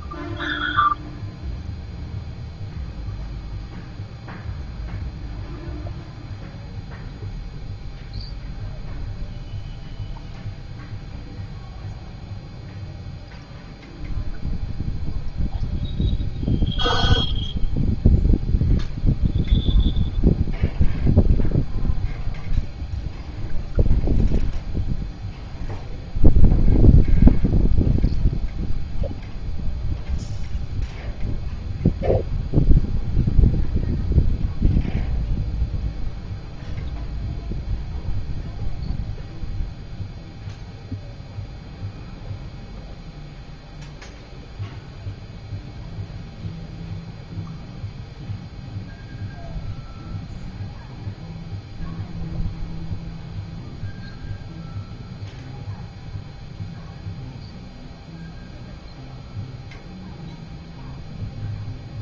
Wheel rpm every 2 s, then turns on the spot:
0, 0, 0, 0, 0, 0, 0, 0, 0, 0, 0, 0, 0, 0, 0, 0, 0, 0, 0, 0, 0, 0, 0, 0, 0, 0, 0, 0, 0, 0, 0.
none